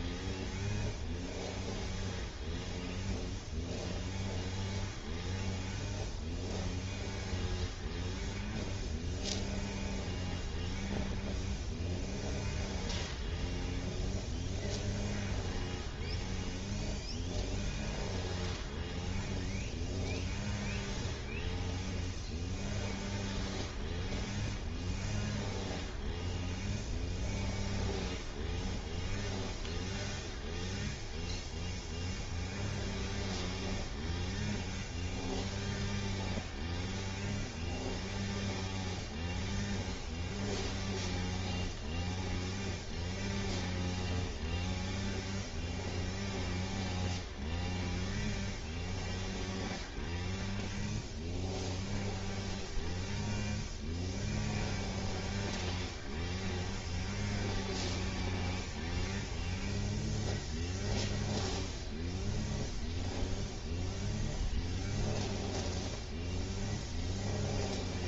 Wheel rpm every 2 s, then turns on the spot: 0, 0, 0, 0, 0, 0, 0, 0, 0, 0, 0, 0, 0, 0, 0, 0, 0, 0, 0, 0, 0, 0, 0, 0, 0, 0, 0, 0, 0, 0, 0, 0, 0, 0.
none